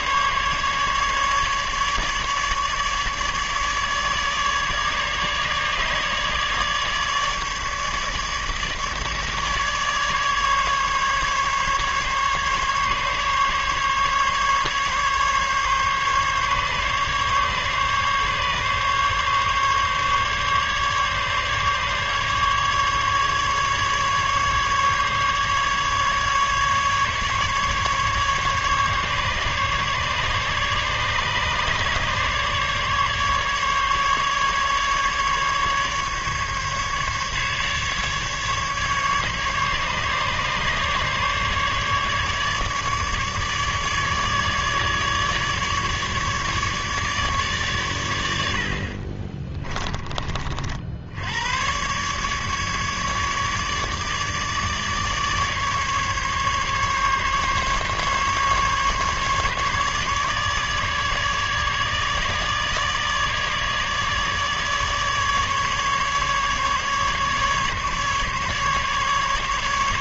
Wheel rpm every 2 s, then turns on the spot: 150, 150, 150, 150, 150, 140, 140, 140, 140, 140, 140, 150, 150, 150, 140, 140, 140, 150, 150, 140, 150, 150, 150, 150, 60, 50, 150, 150, 140, 140, 150, 150, 150, 150, 150.
none